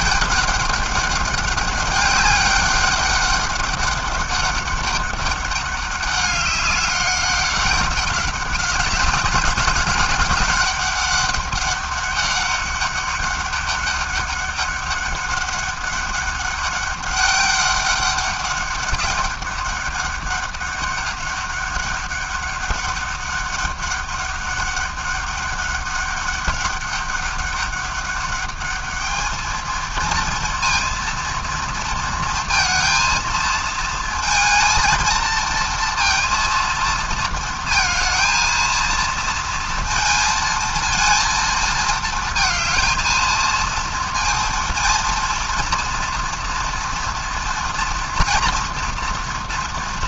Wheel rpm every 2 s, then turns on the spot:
200, 200, 200, 200, 190, 200, 200, 200, 200, 200, 200, 200, 200, 200, 210, 230, 230, 230, 230, 220, 220, 220, 230, 230, 230.
none